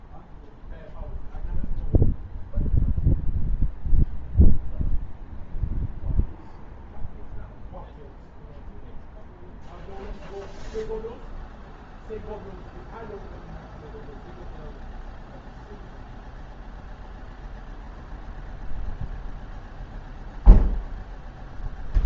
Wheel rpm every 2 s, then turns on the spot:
0, 0, 0, 0, 0, 0, 0, 0, 0, 0, 0.
none